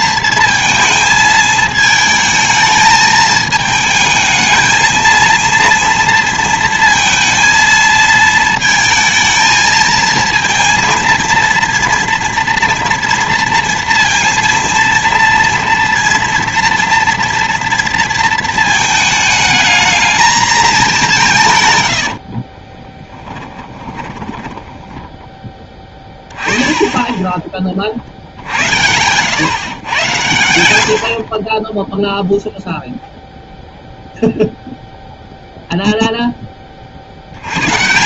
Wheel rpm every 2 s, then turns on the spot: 230, 220, 220, 230, 220, 230, 230, 230, 230, 230, 220, 30, 10, 10, 40, 100, 0, 0, 10.
22-26